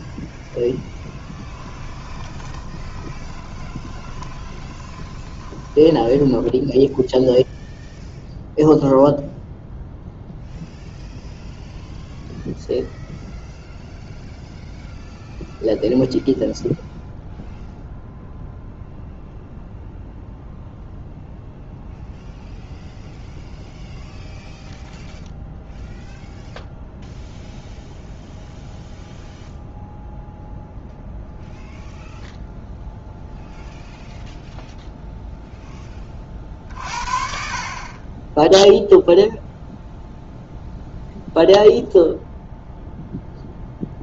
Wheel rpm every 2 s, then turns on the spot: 10, 30, 20, 0, 0, 0, 0, 0, 0, 0, 0, 0, 0, 0, 0, 0, 0, 0, 50, 0, 0, 0.
0-6